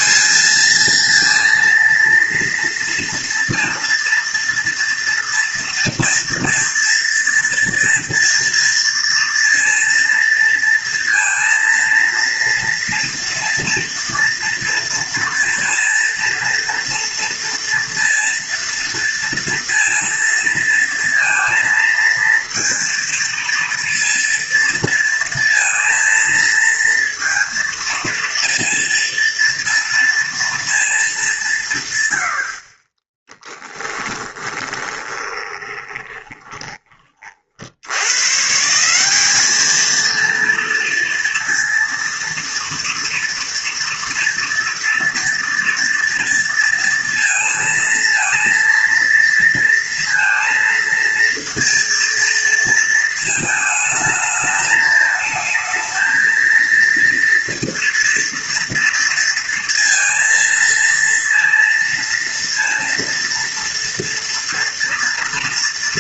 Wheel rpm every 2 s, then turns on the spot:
220, 230, 230, 230, 230, 230, 230, 230, 230, 230, 230, 230, 230, 230, 230, 230, 60, 20, 30, 160, 240, 230, 230, 230, 230, 230, 230, 220, 230, 230, 230, 230, 230.
34-38